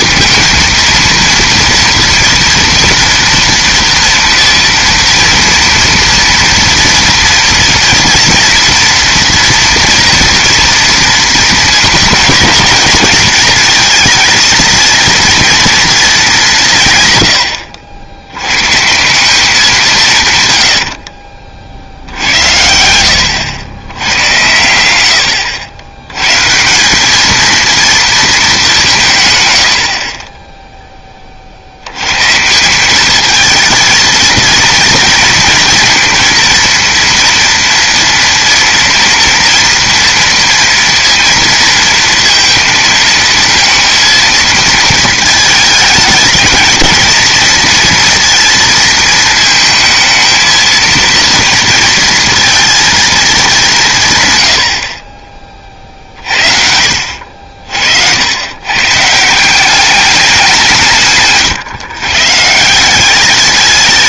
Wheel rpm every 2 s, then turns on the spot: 230, 230, 230, 230, 230, 230, 220, 230, 140, 140, 90, 80, 90, 180, 180, 10, 170, 220, 230, 230, 230, 230, 230, 220, 230, 220, 230, 80, 60, 130, 180, 160.
20-22